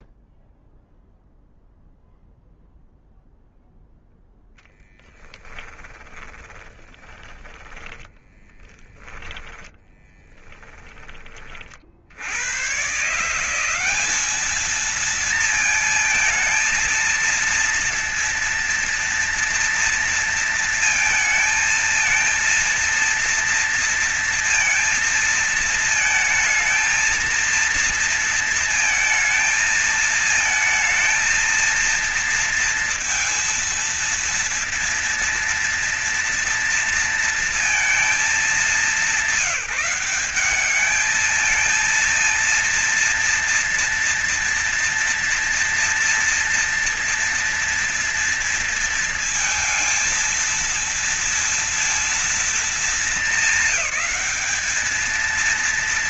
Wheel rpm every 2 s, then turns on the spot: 0, 0, 10, 10, 10, 20, 130, 220, 230, 230, 230, 230, 230, 230, 230, 230, 230, 230, 230, 200, 210, 230, 230, 230, 230, 230, 220, 220.
6-10